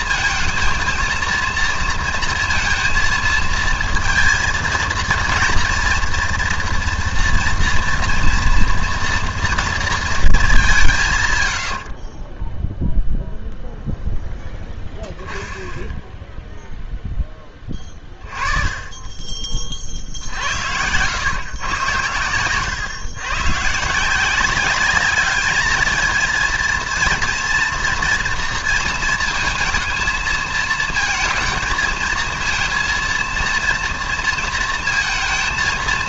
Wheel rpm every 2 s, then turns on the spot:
230, 230, 230, 230, 230, 200, 20, 10, 0, 30, 100, 110, 190, 230, 230, 220, 230, 230.
12-14